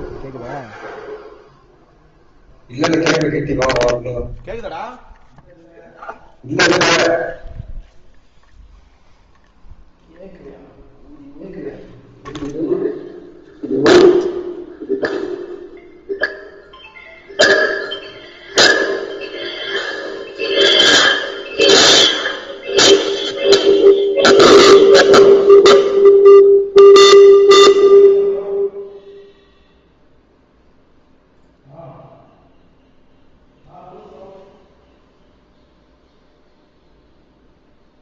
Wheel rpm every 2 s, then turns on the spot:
0, 0, 0, 0, 0, 0, 0, 0, 0, 0, 0, 0, 0, 0, 0, 0, 0, 0, 0.
none